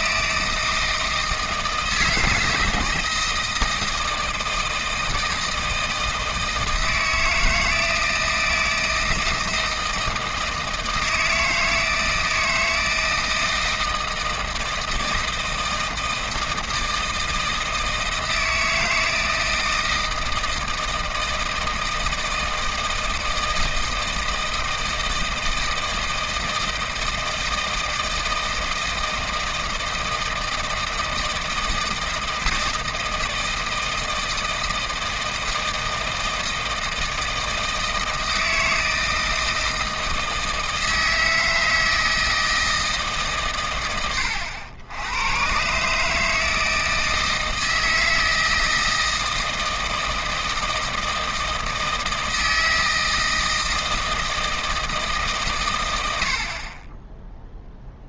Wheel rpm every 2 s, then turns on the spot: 160, 160, 160, 160, 160, 160, 160, 160, 160, 160, 160, 160, 160, 160, 160, 160, 160, 160, 160, 160, 160, 160, 90, 160, 160, 160, 160, 160, 40.
none